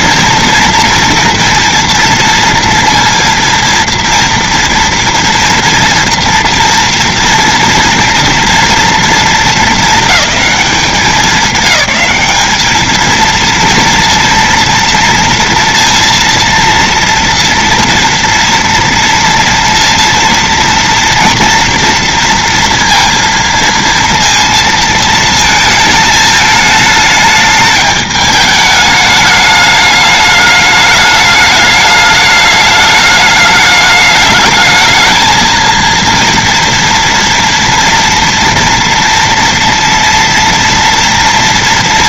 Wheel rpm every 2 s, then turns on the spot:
240, 240, 240, 230, 240, 220, 200, 230, 230, 230, 230, 230, 230, 220, 210, 210, 210, 210, 230, 230, 230.
none